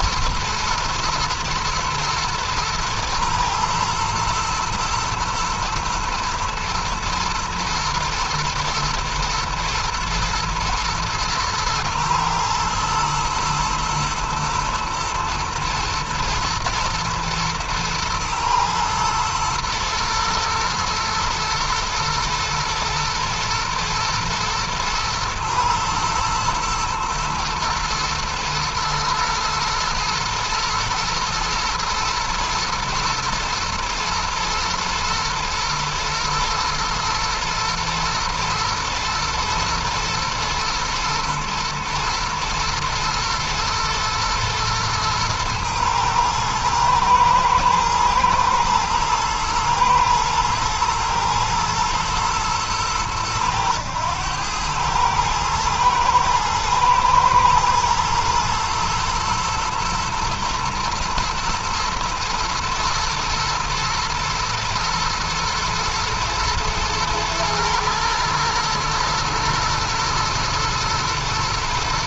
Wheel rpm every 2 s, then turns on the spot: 120, 110, 110, 120, 110, 110, 120, 120, 110, 110, 120, 110, 120, 120, 110, 110, 110, 110, 110, 120, 120, 120, 120, 110, 110, 120, 100, 110, 120, 120, 110, 110, 110, 120, 110, 110.
none